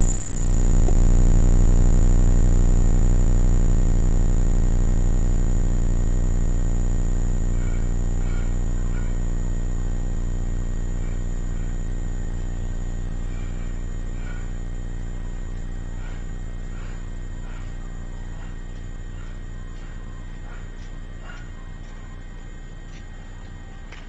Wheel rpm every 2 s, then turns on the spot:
0, 0, 0, 0, 0, 0, 0, 0, 0, 0, 0, 0.
none